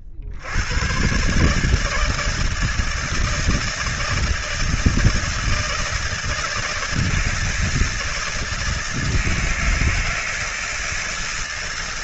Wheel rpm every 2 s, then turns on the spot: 30, 150, 160, 160, 160, 160.
none